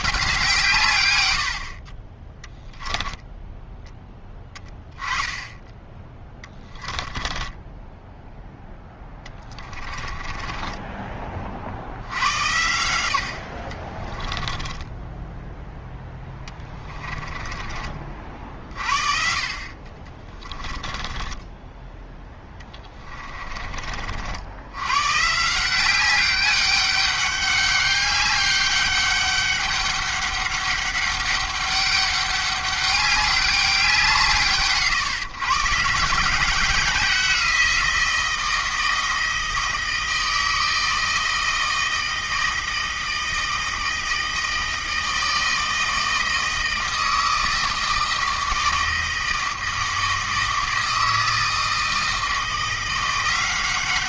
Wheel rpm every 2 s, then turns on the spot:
140, 10, 10, 10, 0, 20, 90, 10, 20, 50, 20, 10, 100, 200, 200, 200, 200, 140, 180, 170, 160, 160, 160, 160, 160, 160, 170.
2-4 6-8 10-12 14-18 20-24